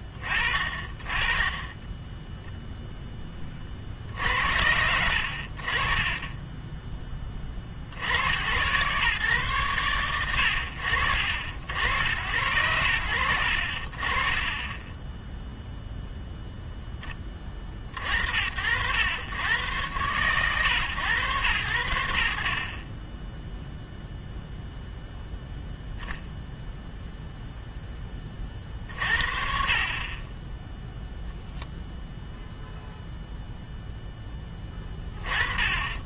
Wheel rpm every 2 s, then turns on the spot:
0, 70, 20, 90, 90, 60, 20, 0, 80, 120, 60, 0, 0, 30, 30, 0, 0, 30.
none